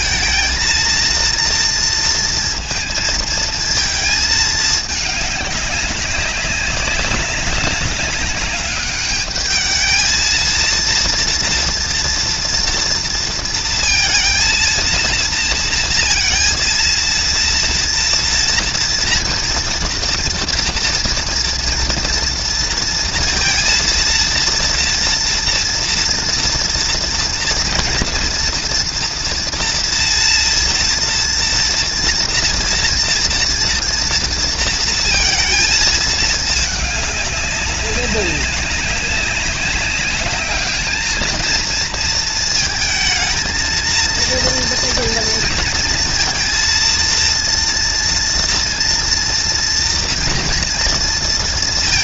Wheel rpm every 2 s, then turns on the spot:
230, 230, 210, 200, 210, 230, 230, 230, 230, 230, 230, 230, 230, 230, 230, 230, 230, 230, 210, 200, 220, 220, 230, 230, 230, 230.
none